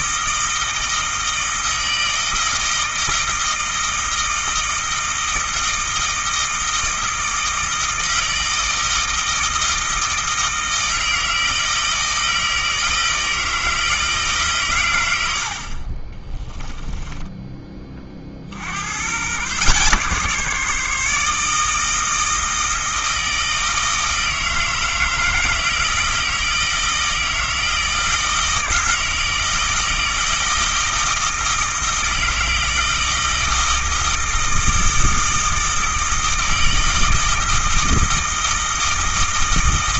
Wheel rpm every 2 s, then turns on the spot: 160, 160, 160, 160, 160, 160, 160, 130, 10, 80, 150, 160, 160, 160, 160, 160, 160, 160, 160, 160.
16-18